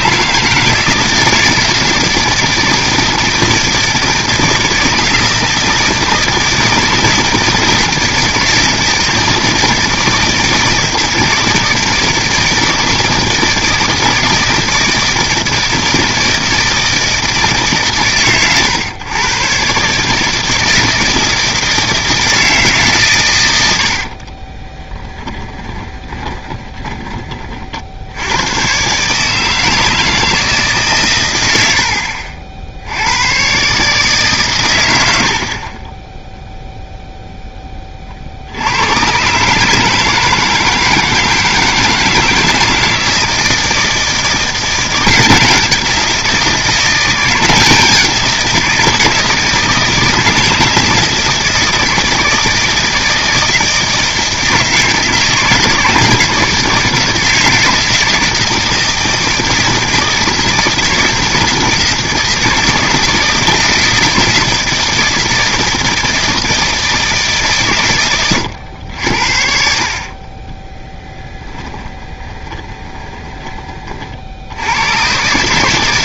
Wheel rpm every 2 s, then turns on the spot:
160, 160, 160, 160, 160, 160, 160, 160, 160, 120, 160, 150, 10, 20, 120, 140, 80, 100, 0, 100, 160, 160, 180, 170, 170, 160, 160, 160, 160, 160, 160, 170, 160, 160, 90, 10, 20, 100.
24-26 70-74